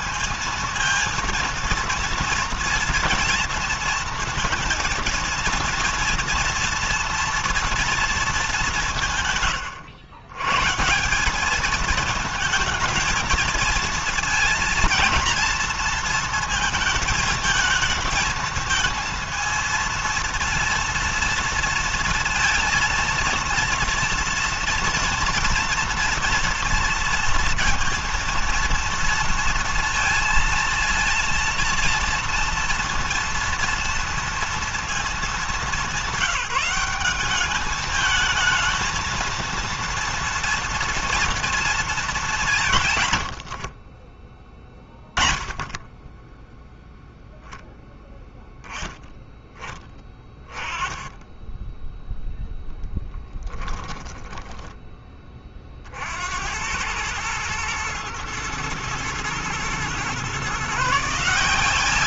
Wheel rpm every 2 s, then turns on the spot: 230, 230, 230, 230, 150, 160, 230, 230, 220, 230, 230, 230, 240, 230, 230, 230, 230, 220, 200, 230, 230, 140, 20, 0, 10, 20, 0, 20, 90, 110, 150.
42-44